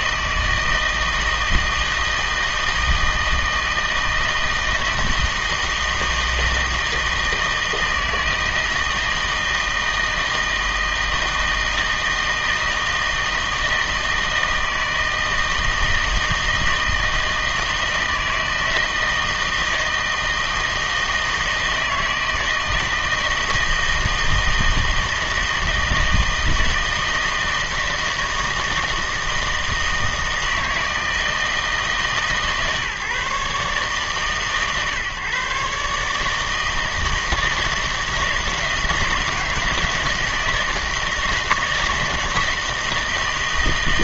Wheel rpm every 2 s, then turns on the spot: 160, 160, 160, 160, 160, 160, 160, 160, 160, 160, 160, 160, 160, 160, 160, 160, 140, 140, 160, 160, 160, 170.
none